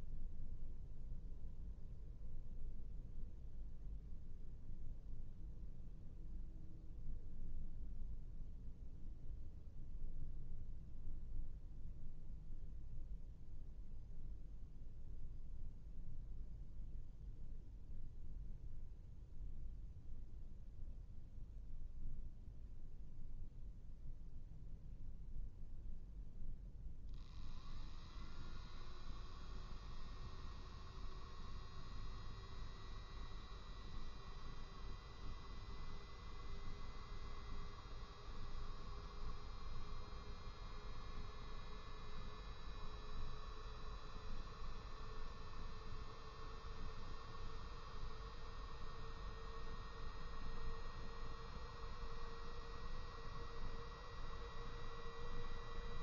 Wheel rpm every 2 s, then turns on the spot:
0, 0, 0, 0, 0, 0, 0, 0, 0, 0, 0, 0, 0, 0, 0, 0, 0, 0, 0, 0, 0, 0, 0, 0, 0, 0, 0, 0.
none